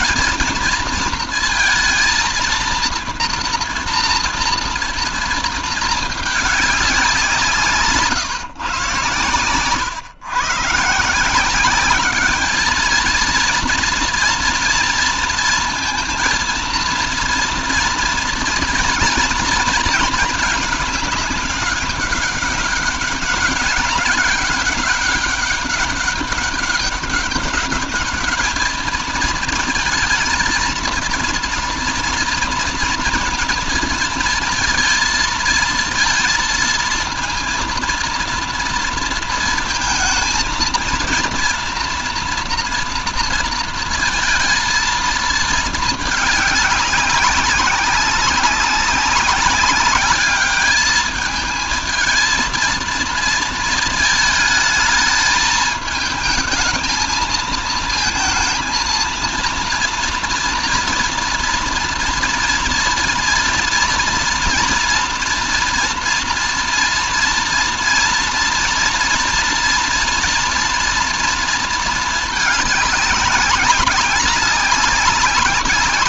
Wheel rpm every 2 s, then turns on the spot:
220, 230, 230, 210, 140, 120, 210, 230, 230, 230, 230, 200, 190, 200, 210, 230, 230, 230, 230, 230, 220, 230, 230, 210, 200, 200, 220, 220, 220, 220, 240, 230, 230, 230, 230, 240, 220, 200.
none